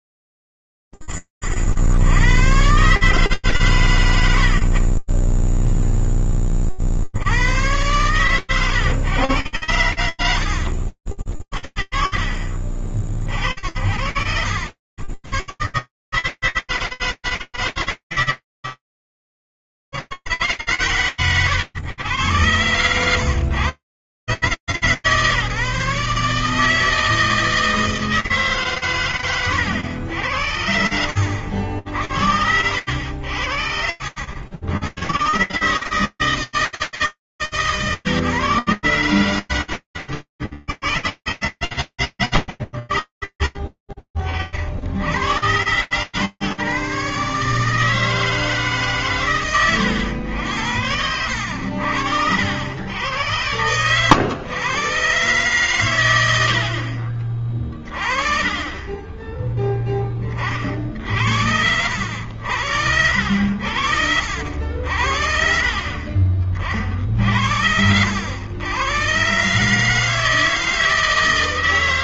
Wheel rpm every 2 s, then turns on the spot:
20, 130, 20, 70, 110, 60, 40, 90, 140, 140, 80, 110, 150, 160, 110, 70, 70, 130, 150, 130, 100, 30, 80, 150, 120, 70, 100, 130, 40, 10, 80, 70, 50, 70, 140, 160.
30-32